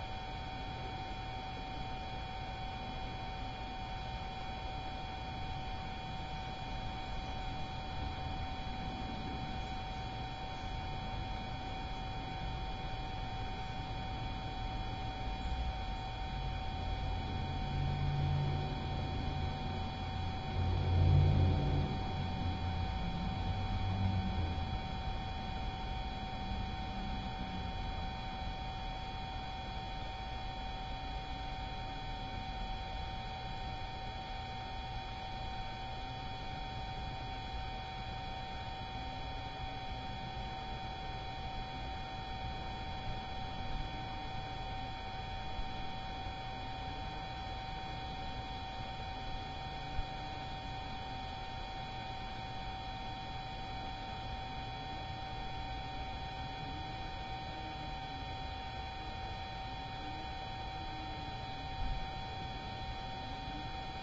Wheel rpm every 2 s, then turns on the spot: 0, 0, 0, 0, 0, 0, 0, 0, 0, 0, 0, 0, 0, 0, 0, 0, 0, 0, 0, 0, 0, 0, 0, 0, 0, 0, 0, 0, 0, 0, 0, 0.
none